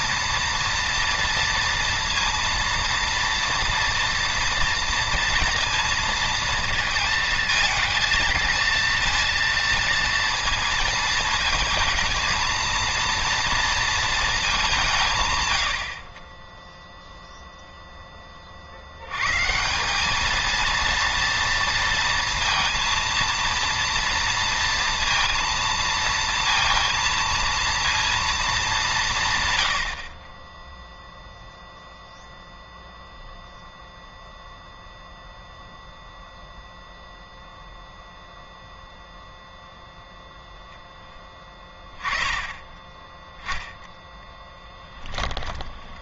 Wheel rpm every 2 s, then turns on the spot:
240, 230, 230, 230, 230, 230, 230, 210, 10, 40, 230, 230, 230, 230, 210, 10, 0, 0, 0, 0, 0, 10, 10.
44-46